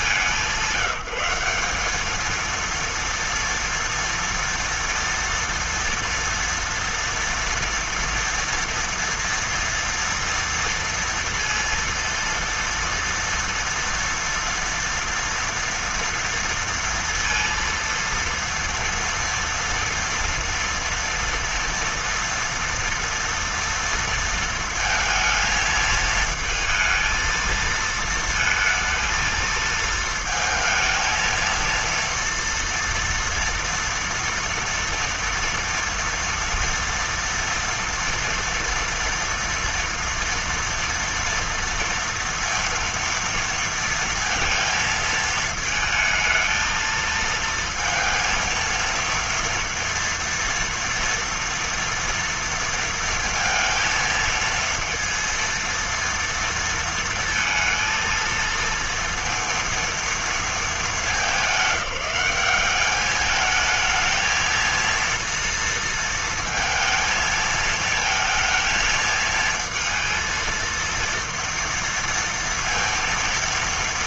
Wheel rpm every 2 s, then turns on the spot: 190, 230, 230, 230, 230, 240, 230, 230, 230, 230, 240, 230, 230, 220, 220, 220, 230, 230, 240, 240, 230, 230, 230, 220, 230, 230, 230, 230, 230, 230, 210, 200, 230, 230, 220, 230, 230.
none